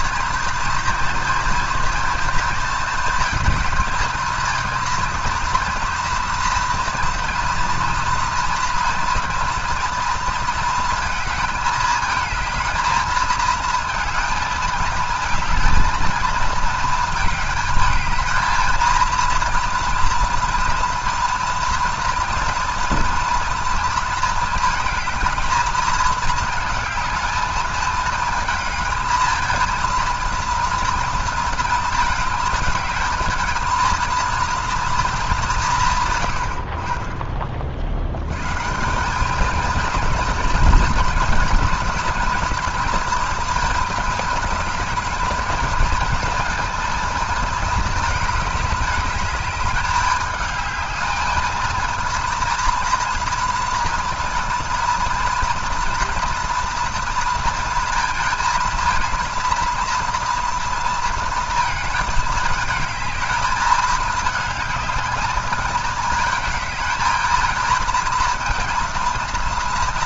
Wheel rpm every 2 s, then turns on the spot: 230, 230, 230, 230, 230, 230, 230, 220, 220, 220, 230, 230, 220, 220, 220, 230, 220, 230, 60, 150, 230, 230, 220, 230, 210, 220, 230, 230, 230, 230, 230, 210, 220, 220, 230.
none